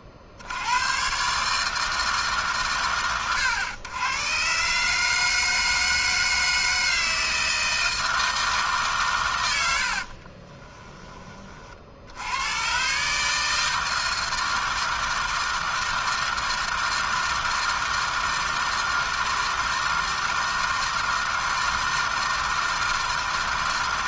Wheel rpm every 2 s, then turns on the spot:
60, 140, 120, 160, 150, 20, 110, 160, 160, 160, 160, 160.
10-12